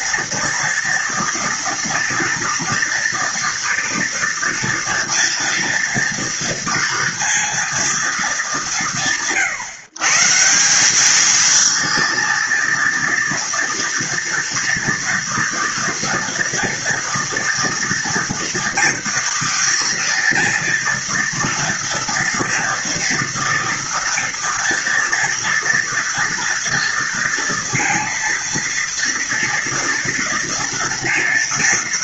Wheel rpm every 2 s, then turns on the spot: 230, 240, 240, 230, 130, 210, 230, 240, 230, 230, 230, 230, 230, 230, 240, 230.
none